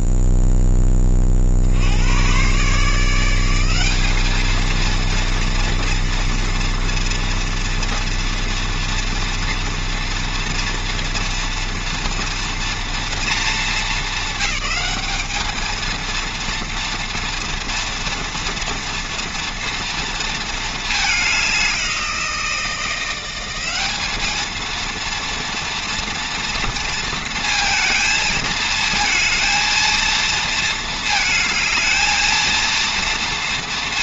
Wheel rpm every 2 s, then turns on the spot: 10, 140, 230, 230, 240, 240, 230, 220, 230, 230, 220, 170, 230, 230, 220, 230, 230.
none